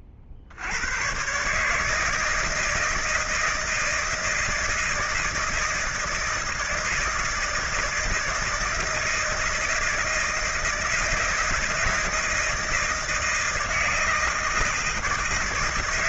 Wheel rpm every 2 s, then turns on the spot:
60, 160, 160, 160, 160, 160, 160, 160.
none